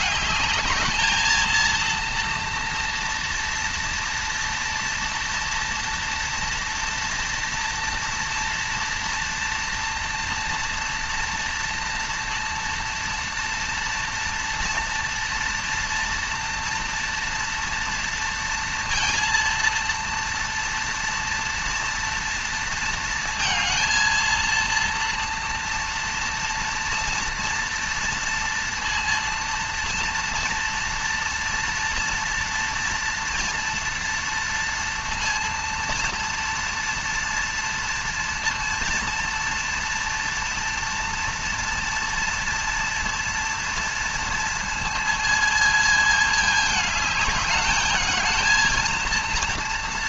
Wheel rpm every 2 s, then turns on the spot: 220, 240, 240, 230, 230, 230, 230, 230, 230, 230, 240, 230, 230, 230, 230, 230, 230, 230, 230, 230, 230, 230, 230, 210, 230.
none